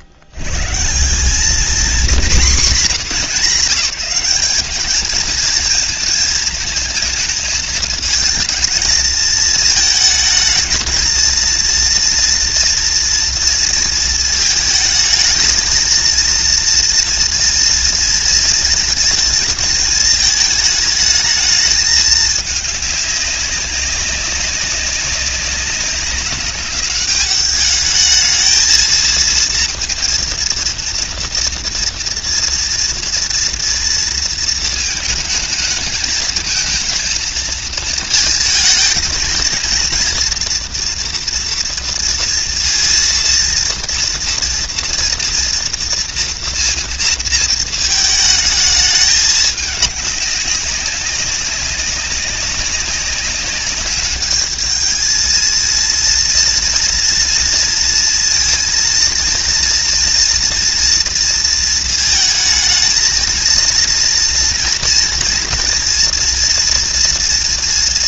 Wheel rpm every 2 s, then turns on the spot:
80, 190, 190, 220, 230, 220, 230, 220, 230, 230, 220, 210, 200, 200, 220, 230, 230, 220, 220, 220, 230, 230, 230, 230, 220, 200, 200, 210, 230, 230, 230, 220, 230, 230.
none